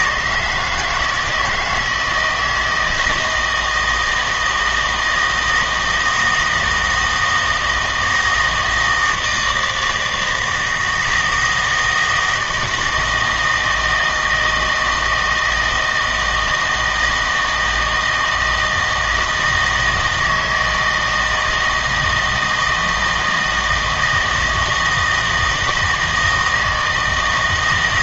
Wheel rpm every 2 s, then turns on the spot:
160, 160, 160, 160, 160, 160, 160, 160, 160, 160, 160, 160, 160, 160.
none